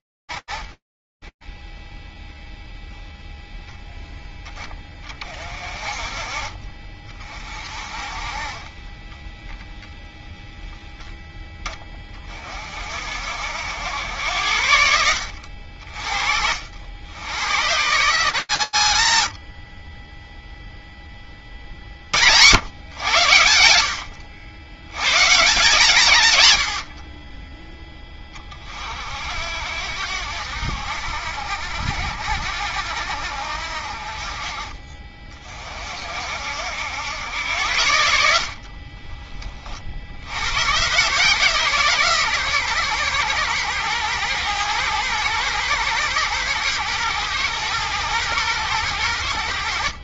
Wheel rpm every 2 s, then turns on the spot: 20, 0, 30, 50, 10, 10, 70, 60, 120, 30, 70, 80, 130, 20, 70, 70, 40, 60, 60, 90, 140, 110, 120, 120, 70.
36-38